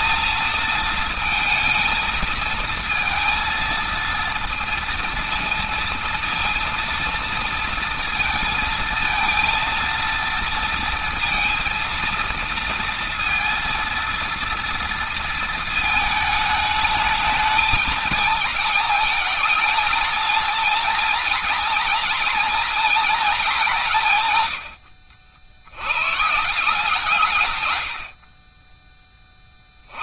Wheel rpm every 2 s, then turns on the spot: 220, 220, 230, 230, 220, 230, 230, 230, 220, 220, 230, 230, 70, 150, 20.
none